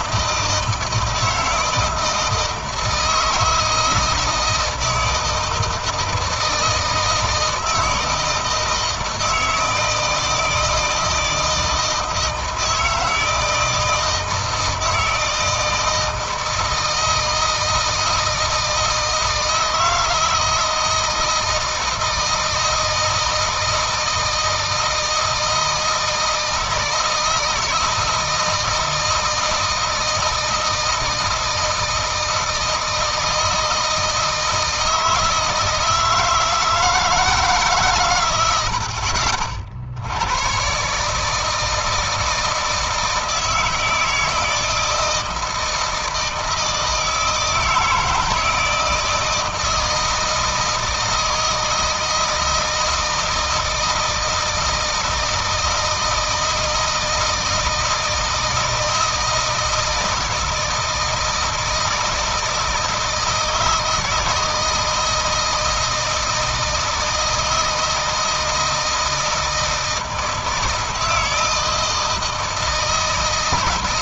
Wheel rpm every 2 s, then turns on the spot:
160, 160, 170, 160, 160, 160, 160, 160, 160, 160, 160, 160, 160, 160, 160, 160, 160, 160, 160, 60, 140, 160, 160, 160, 160, 160, 160, 160, 160, 160, 160, 160, 160, 160, 160, 160, 160.
none